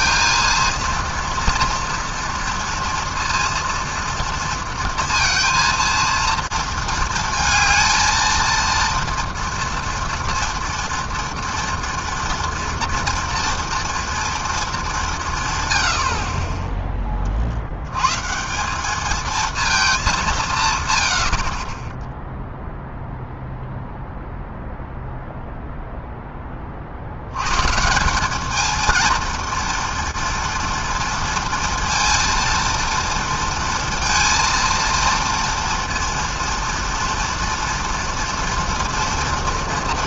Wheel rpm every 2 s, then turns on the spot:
230, 230, 230, 220, 230, 240, 230, 230, 30, 170, 160, 0, 0, 20, 210, 230, 230, 230, 240, 230.
none